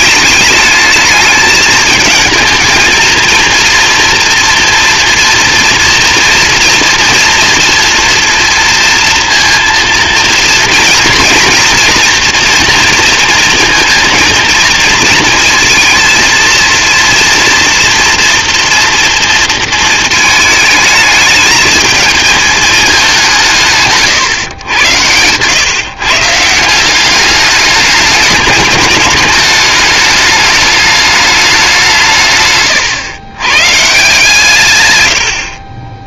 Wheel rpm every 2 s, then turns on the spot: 210, 230, 240, 230, 230, 240, 230, 220, 230, 230, 220, 220, 110, 170, 210, 210, 120, 130.
32-34